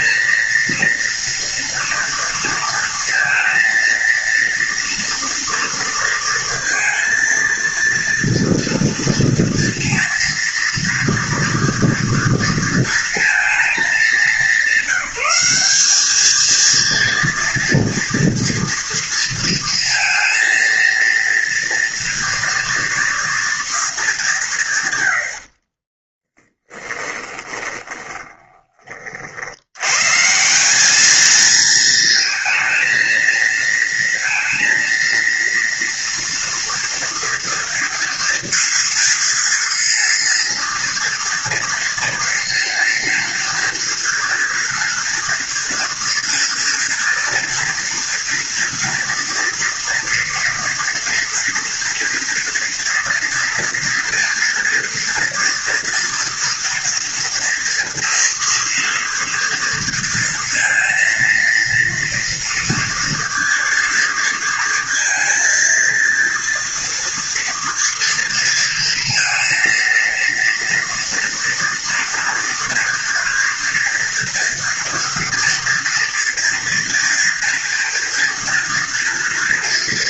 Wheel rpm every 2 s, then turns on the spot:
230, 230, 230, 230, 230, 230, 230, 200, 230, 230, 230, 230, 170, 20, 20, 180, 230, 230, 230, 230, 230, 230, 230, 230, 230, 230, 230, 230, 230, 230, 230, 230, 230, 230, 230, 230, 230, 230, 230, 230.
26-28